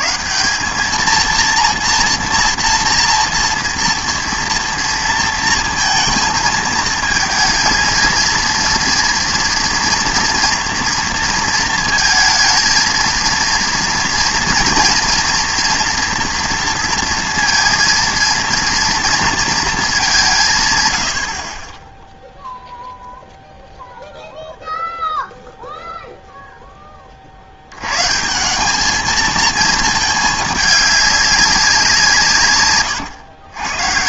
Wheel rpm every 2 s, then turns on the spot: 110, 230, 240, 220, 230, 230, 230, 230, 230, 230, 170, 0, 0, 20, 220, 200, 130.
none